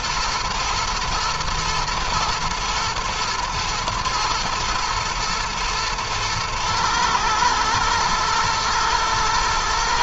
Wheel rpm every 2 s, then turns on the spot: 120, 120, 110, 110, 120.
none